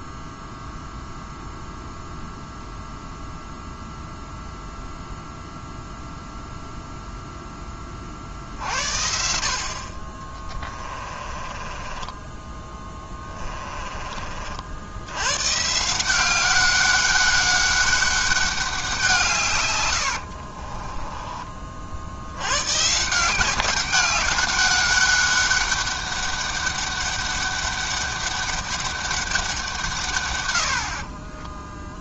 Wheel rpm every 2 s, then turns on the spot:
0, 0, 0, 0, 60, 20, 20, 70, 200, 190, 30, 150, 200, 200, 200, 50.
10-14 20-22